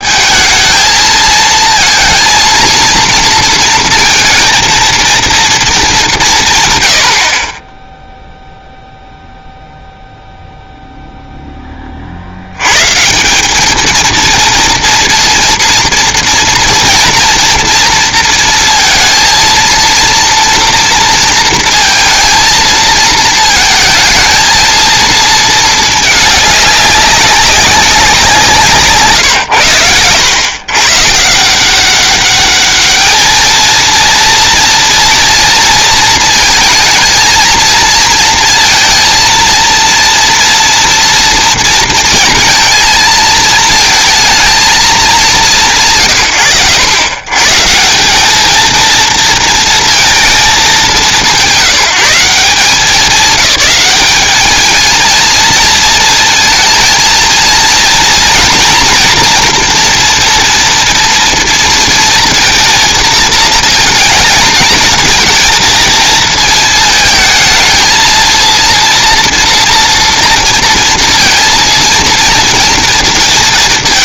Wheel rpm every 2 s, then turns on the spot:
220, 230, 230, 120, 0, 0, 90, 230, 230, 230, 230, 230, 220, 200, 160, 120, 210, 230, 220, 230, 230, 230, 220, 80, 220, 210, 170, 210, 230, 230, 230, 230, 220, 220, 230, 230, 230.
none